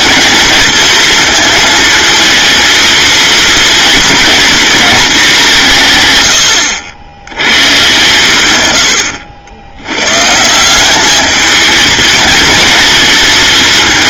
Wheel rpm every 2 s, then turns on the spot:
230, 230, 210, 110, 80, 210, 230.
none